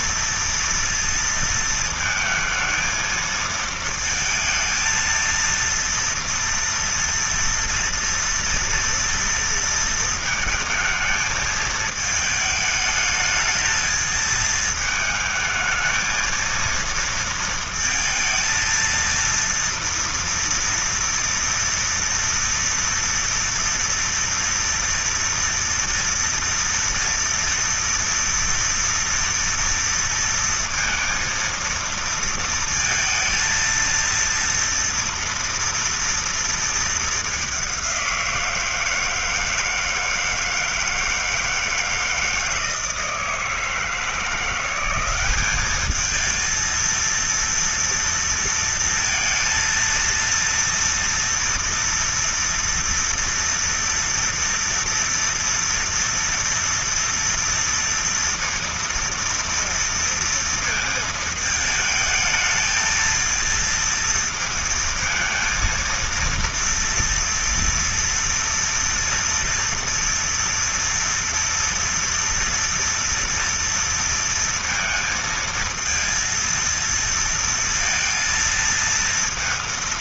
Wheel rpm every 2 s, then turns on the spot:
230, 220, 230, 230, 230, 220, 220, 220, 230, 230, 230, 230, 230, 230, 230, 230, 220, 240, 200, 160, 160, 160, 200, 230, 230, 230, 230, 230, 230, 230, 220, 230, 230, 230, 240, 230, 230, 230, 230, 230.
none